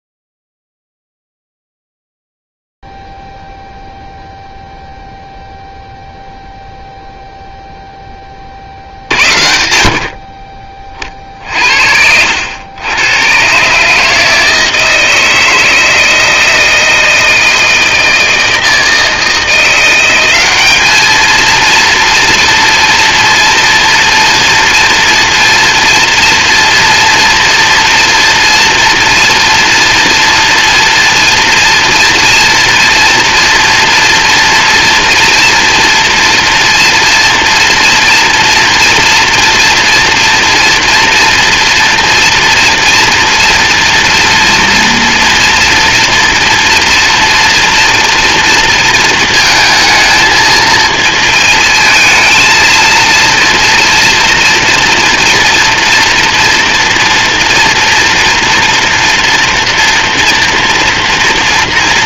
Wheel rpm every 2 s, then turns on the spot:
0, 0, 0, 0, 50, 40, 120, 160, 160, 160, 220, 230, 230, 230, 230, 230, 230, 230, 240, 230, 240, 230, 230, 240, 230, 220, 230, 230, 230, 240, 240.
none